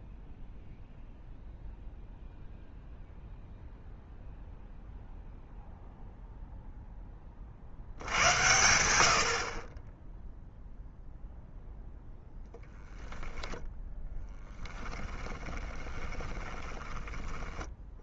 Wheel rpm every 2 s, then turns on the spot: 0, 0, 0, 0, 100, 0, 0, 10, 20.
14-18